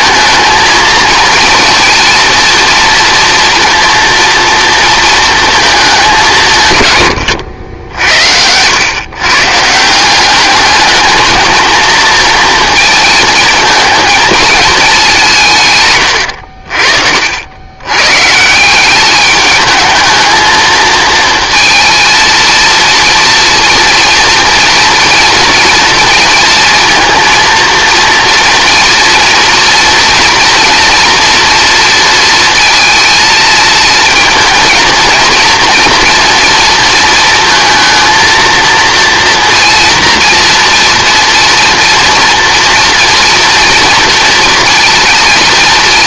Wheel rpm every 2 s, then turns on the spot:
230, 230, 230, 150, 100, 210, 230, 210, 70, 160, 220, 230, 230, 230, 230, 230, 230, 230, 230, 230, 240, 240, 230.
none